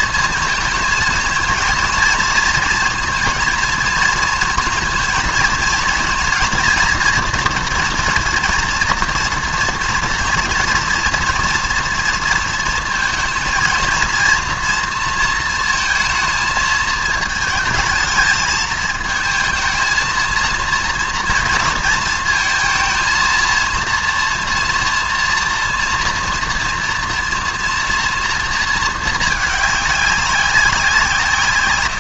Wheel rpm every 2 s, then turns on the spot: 220, 230, 230, 230, 230, 230, 230, 230, 220, 220, 230, 230, 240, 230, 220, 180.
none